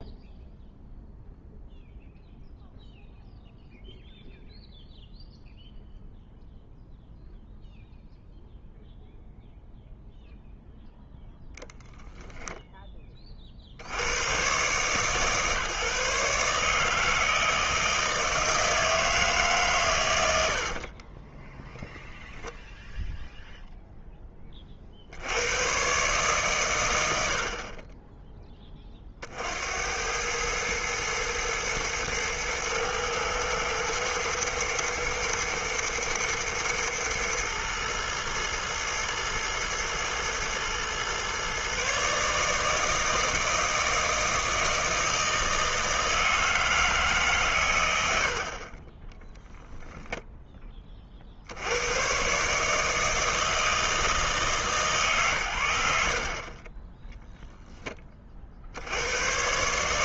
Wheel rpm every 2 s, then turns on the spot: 0, 0, 0, 0, 0, 0, 10, 140, 160, 160, 50, 0, 50, 110, 20, 110, 110, 110, 120, 110, 120, 160, 160, 160, 30, 20, 150, 150, 20, 70.
20-22